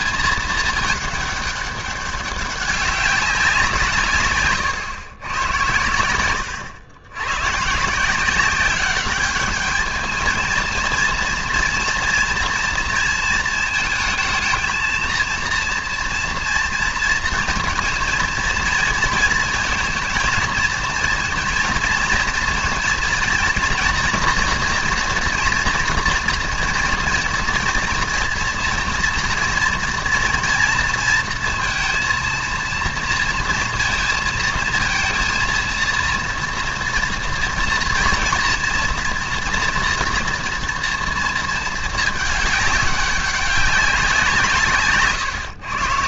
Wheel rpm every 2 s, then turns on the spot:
220, 200, 120, 100, 190, 230, 230, 220, 230, 230, 230, 230, 230, 230, 230, 230, 230, 230, 230, 230, 240, 210, 150.
6-8